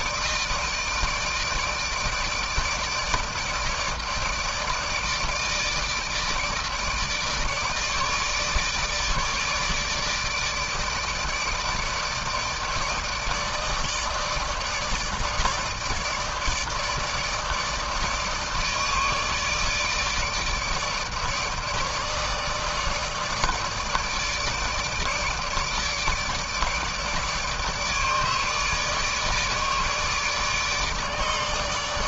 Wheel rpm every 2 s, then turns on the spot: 160, 160, 150, 150, 150, 160, 160, 160, 160, 160, 150, 150, 150, 150, 150, 150.
none